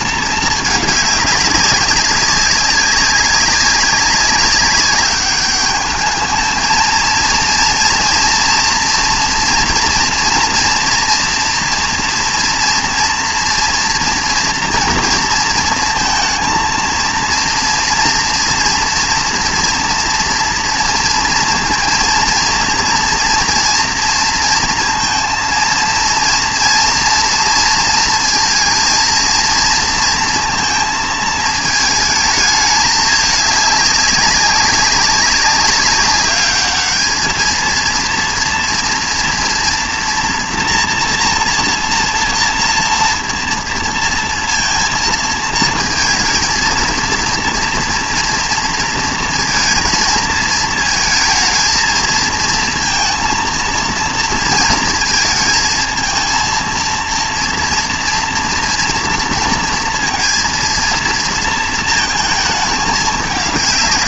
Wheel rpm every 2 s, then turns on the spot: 220, 200, 200, 220, 230, 240, 240, 230, 230, 230, 230, 230, 230, 230, 230, 230, 220, 200, 210, 230, 230, 230, 230, 220, 230, 220, 230, 230, 230, 230, 230, 220.
none